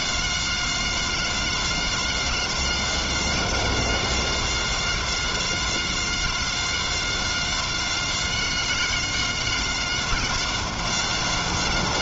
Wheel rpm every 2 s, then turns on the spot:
190, 190, 190, 190, 190, 190.
none